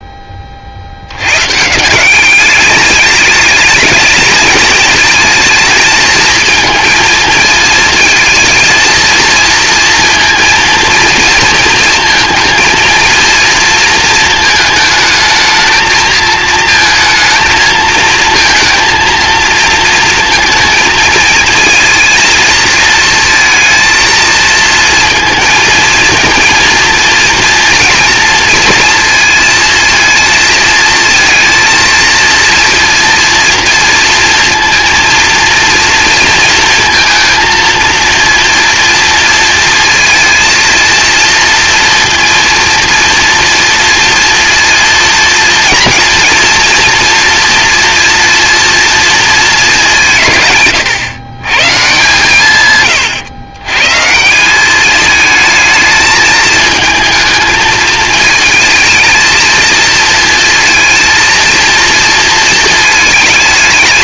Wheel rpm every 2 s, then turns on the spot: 100, 210, 220, 220, 230, 230, 230, 220, 220, 220, 230, 230, 230, 230, 230, 230, 240, 230, 230, 230, 230, 230, 230, 230, 230, 130, 120, 210, 220, 220, 230, 220.
none